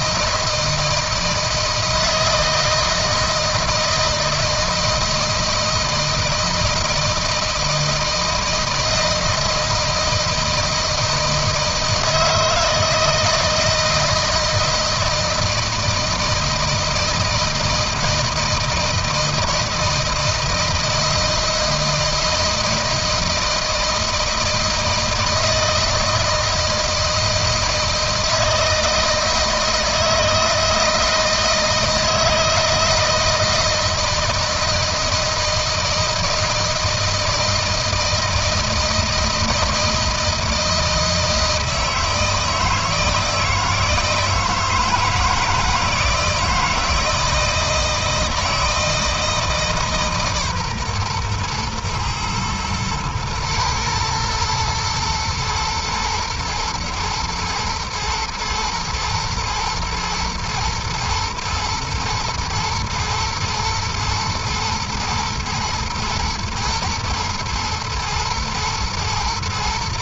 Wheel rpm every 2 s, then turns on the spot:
160, 160, 160, 160, 160, 160, 160, 160, 160, 160, 160, 160, 160, 160, 160, 160, 160, 160, 160, 160, 160, 160, 160, 160, 160, 130, 110, 120, 110, 120, 110, 110, 110, 120, 110.
none